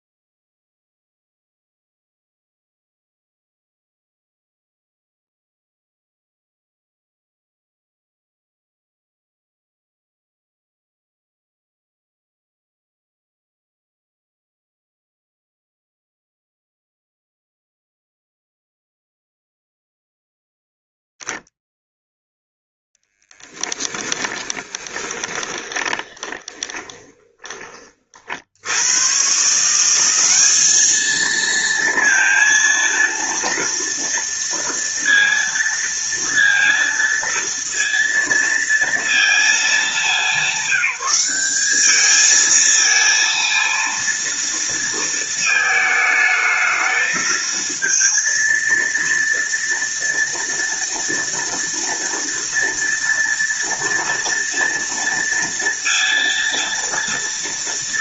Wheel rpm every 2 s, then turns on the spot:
0, 0, 0, 0, 0, 0, 0, 0, 0, 0, 0, 0, 10, 20, 70, 210, 230, 230, 230, 230, 200, 220, 230, 220, 230, 230, 230, 230, 230.
24-28